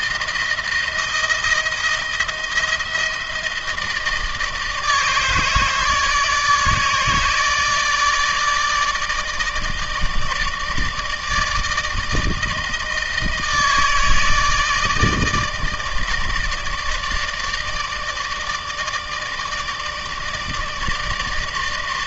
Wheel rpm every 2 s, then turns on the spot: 160, 160, 150, 150, 160, 160, 160, 160, 150, 160, 150.
none